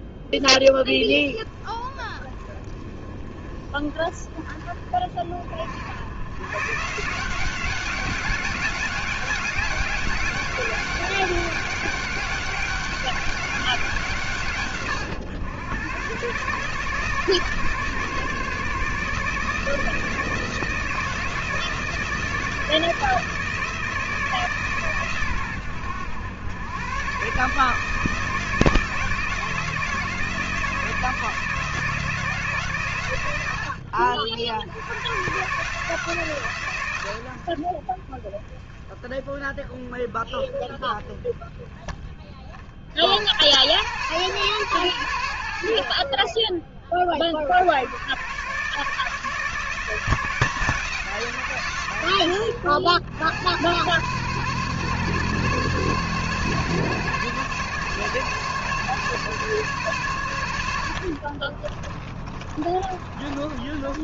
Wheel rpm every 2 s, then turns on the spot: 10, 30, 40, 160, 190, 200, 200, 110, 150, 150, 160, 160, 130, 120, 160, 160, 120, 100, 110, 20, 20, 70, 110, 40, 150, 170, 90, 140, 140, 140, 60, 30.
62-64